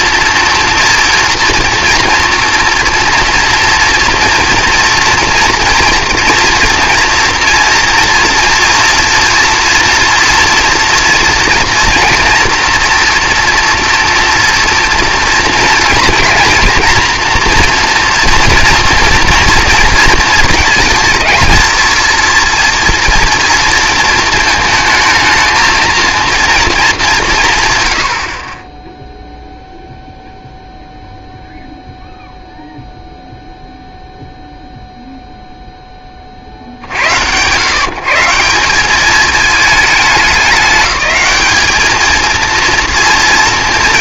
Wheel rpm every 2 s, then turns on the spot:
230, 230, 230, 230, 230, 230, 240, 230, 230, 230, 220, 230, 220, 210, 10, 0, 0, 0, 70, 200, 210, 230.
none